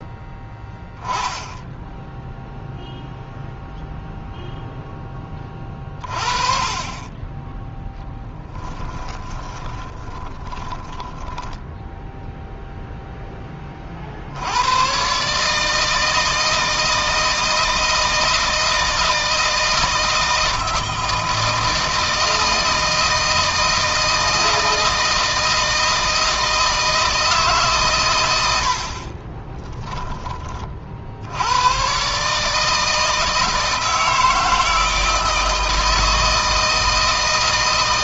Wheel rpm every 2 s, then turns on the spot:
0, 0, 10, 20, 20, 10, 10, 130, 160, 160, 160, 160, 160, 160, 40, 70, 160, 160, 160.
8-12 28-30